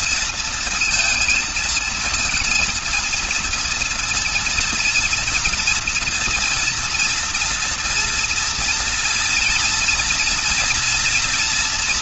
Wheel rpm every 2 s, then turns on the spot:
230, 230, 230, 240, 230, 230.
none